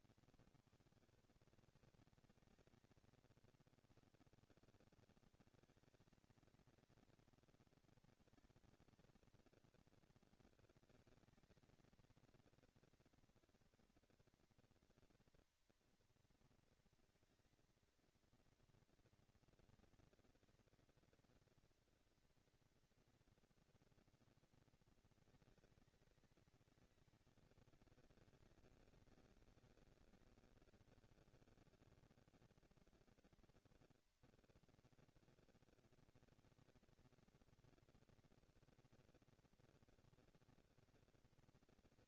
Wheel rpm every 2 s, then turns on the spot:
180, 180, 140, 220, 220, 220, 230, 230, 230, 230, 230, 230, 230, 210, 200, 200, 220, 230, 230, 230, 230.
none